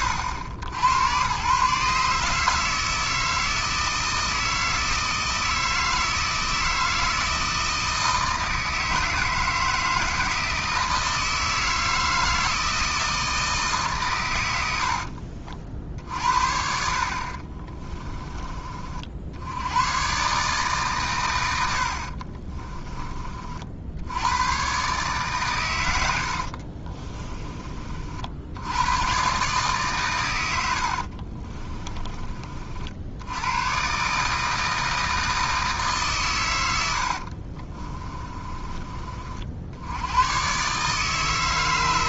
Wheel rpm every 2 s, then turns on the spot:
90, 160, 160, 160, 160, 160, 160, 70, 60, 30, 130, 20, 130, 50, 100, 60, 60, 160, 100, 30, 130.
26-28 30-32